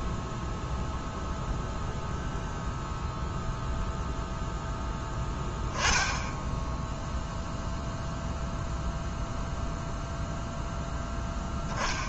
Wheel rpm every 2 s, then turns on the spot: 0, 0, 10, 10, 0, 0.
none